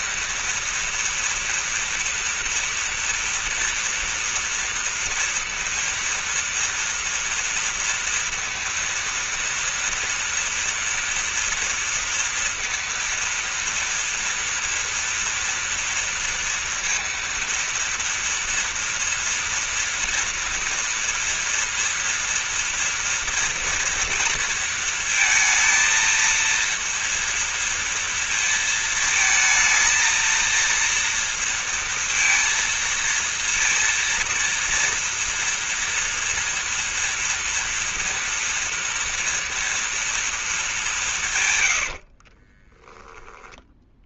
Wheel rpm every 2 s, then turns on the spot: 230, 230, 230, 230, 230, 230, 230, 230, 230, 230, 230, 230, 230, 230, 230, 230, 230, 240, 230, 230, 200, 20.
42-44